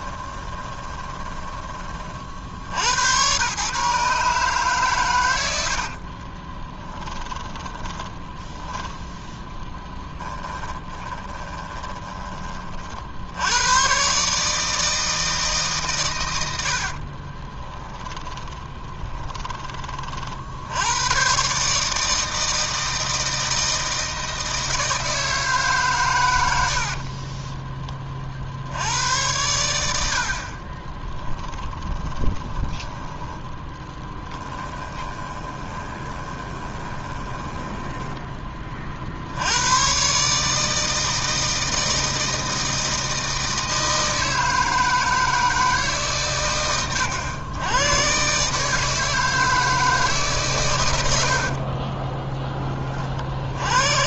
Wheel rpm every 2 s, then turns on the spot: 20, 80, 130, 20, 10, 10, 40, 160, 50, 20, 80, 160, 160, 70, 80, 30, 20, 20, 20, 30, 160, 160, 160, 90, 150, 100, 20.
0-2 6-8 10-12 16-20 30-32 34-38